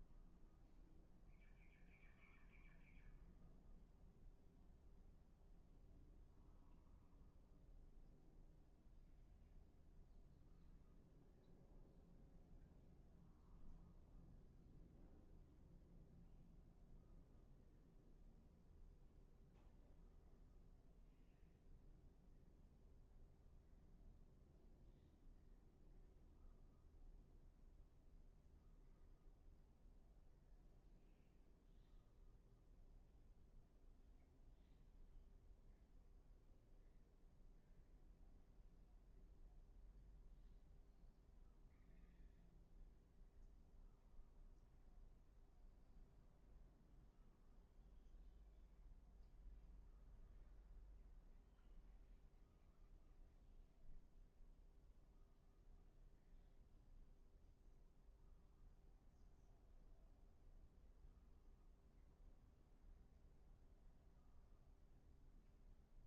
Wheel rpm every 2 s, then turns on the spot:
0, 0, 0, 0, 0, 0, 0, 0, 0, 0, 0, 0, 0, 0, 0, 0, 0, 0, 0, 0, 0, 0, 0, 0, 0, 0, 0, 0, 0, 0, 0, 0, 0.
none